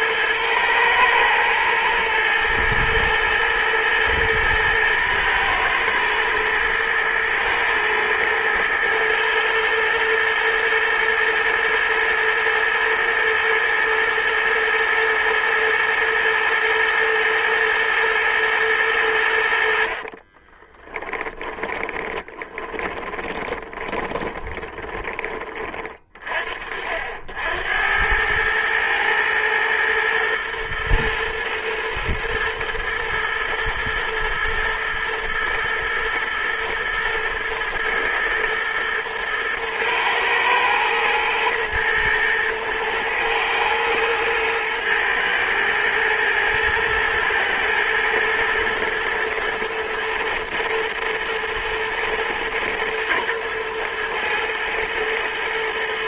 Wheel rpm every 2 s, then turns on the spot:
110, 110, 120, 120, 110, 120, 110, 110, 110, 110, 40, 20, 20, 50, 110, 110, 110, 120, 110, 110, 110, 110, 110, 110, 120, 110, 110, 120.
20-26